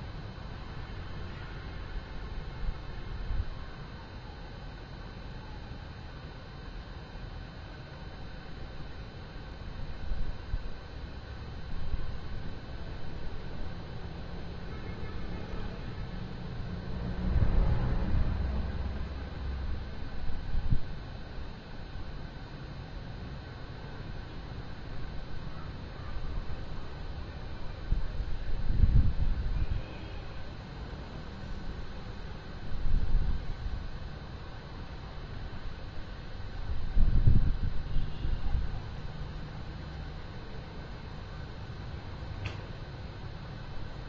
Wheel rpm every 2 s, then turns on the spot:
0, 0, 0, 0, 0, 0, 0, 0, 0, 0, 0, 0, 0, 0, 0, 0, 0, 0, 0, 0, 0, 0.
none